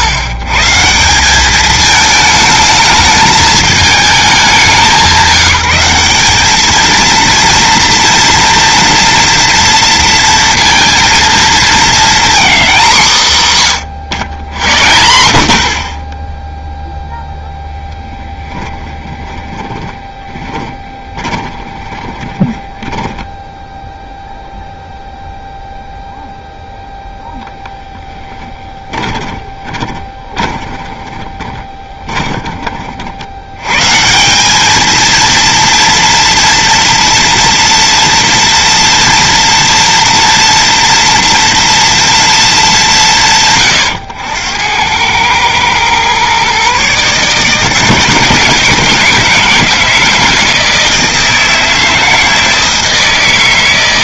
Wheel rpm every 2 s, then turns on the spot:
130, 220, 190, 210, 230, 230, 230, 80, 0, 20, 20, 20, 0, 0, 20, 20, 30, 200, 240, 230, 240, 210, 90, 130, 160, 160, 160.
18-24 28-32